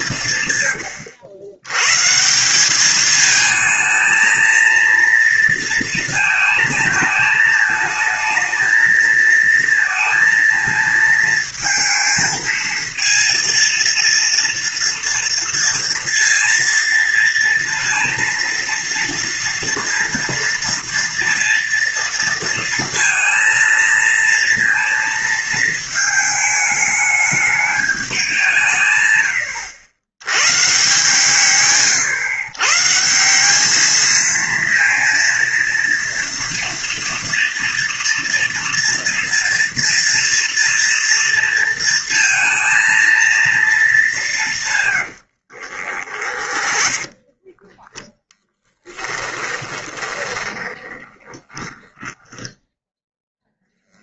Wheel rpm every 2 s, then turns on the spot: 110, 200, 230, 220, 220, 230, 230, 230, 230, 230, 230, 230, 230, 220, 150, 130, 140, 230, 230, 230, 230, 230, 140, 20, 20, 20, 0.
44-52